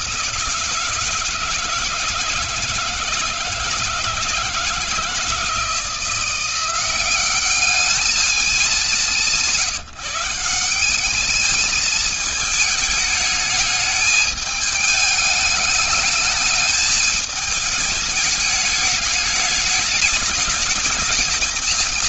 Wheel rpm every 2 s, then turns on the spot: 160, 160, 170, 180, 210, 180, 220, 210, 220, 210, 210.
none